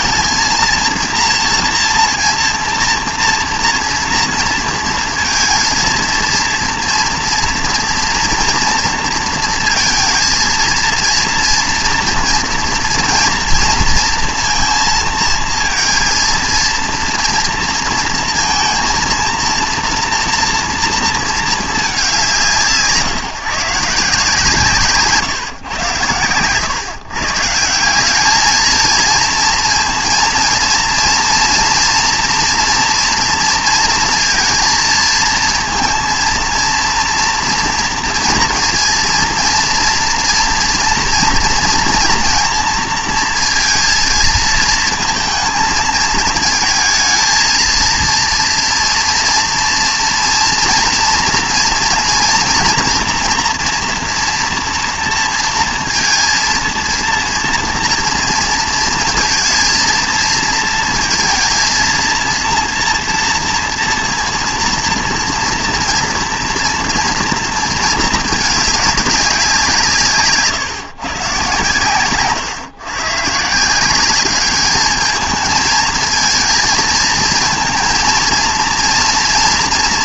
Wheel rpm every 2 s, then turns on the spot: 230, 230, 230, 230, 240, 230, 240, 230, 230, 230, 230, 160, 150, 120, 220, 230, 230, 230, 230, 230, 230, 230, 230, 220, 230, 230, 240, 230, 230, 220, 230, 230, 230, 240, 210, 150, 130, 210, 220, 230.
none